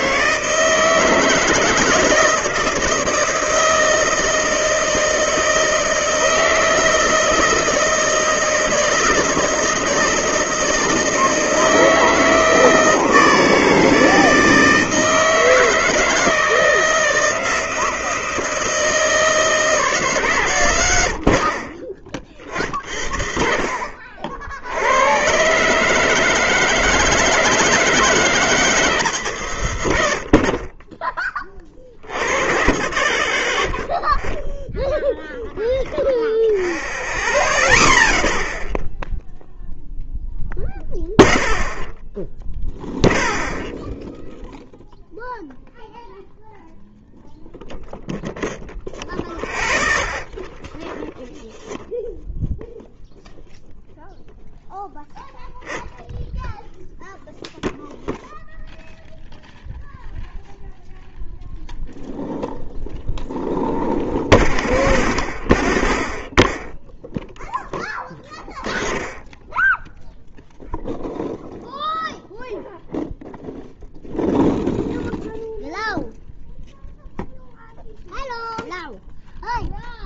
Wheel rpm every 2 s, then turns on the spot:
160, 160, 160, 160, 160, 160, 160, 160, 160, 160, 120, 40, 70, 160, 160, 40, 60, 0, 0, 0, 0, 0, 0, 0, 0, 0, 0, 0, 0, 0, 0, 0, 0, 0, 10, 0, 0, 0, 0, 0.
none